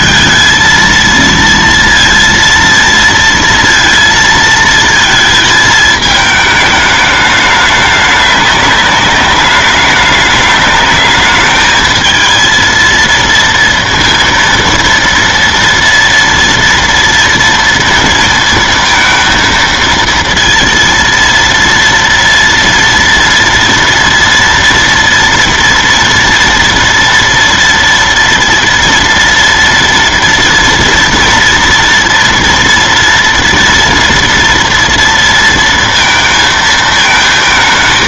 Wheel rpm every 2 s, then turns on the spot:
220, 230, 230, 220, 200, 200, 220, 230, 230, 230, 230, 230, 230, 230, 230, 230, 230, 230, 230.
none